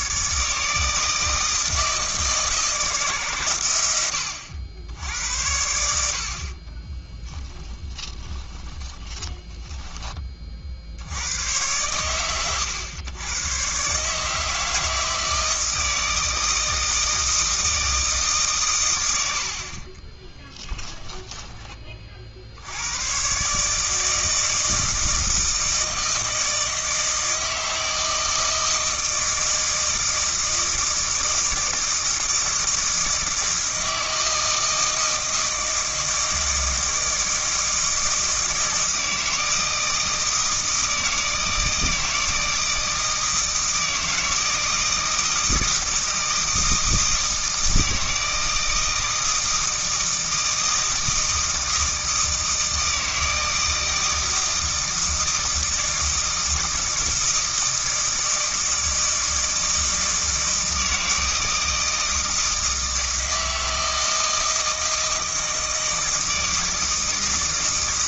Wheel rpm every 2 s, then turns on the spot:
160, 150, 80, 20, 20, 60, 100, 160, 160, 120, 20, 90, 160, 160, 160, 160, 160, 160, 160, 160, 160, 160, 160, 160, 160, 160, 160, 160, 160, 160, 160, 160, 160, 160.
6-10 20-22